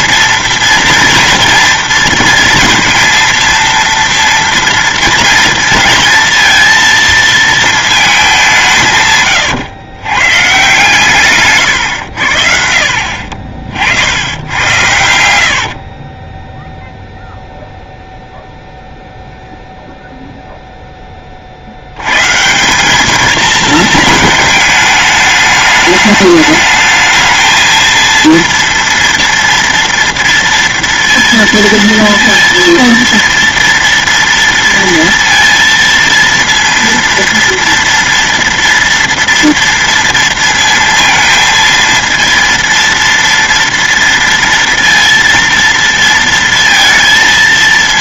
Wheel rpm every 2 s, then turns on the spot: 230, 230, 230, 230, 170, 140, 50, 90, 0, 0, 0, 190, 220, 220, 230, 230, 230, 230, 230, 230, 230, 230, 230, 230.
14-16